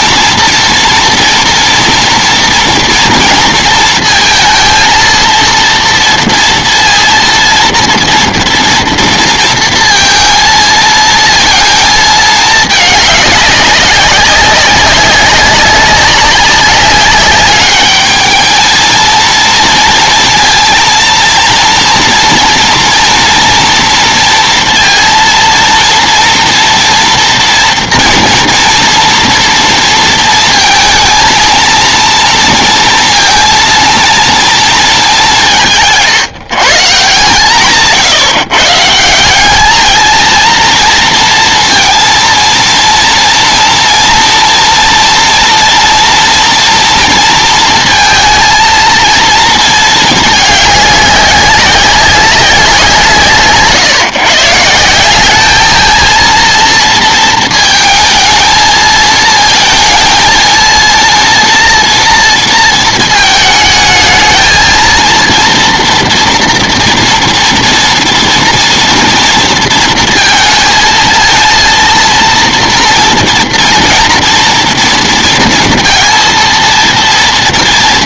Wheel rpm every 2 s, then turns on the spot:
240, 230, 230, 230, 230, 230, 210, 190, 200, 230, 230, 230, 230, 240, 230, 230, 230, 220, 150, 150, 230, 230, 230, 230, 230, 200, 170, 180, 230, 220, 230, 220, 230, 230, 230, 230, 230, 240, 230.
none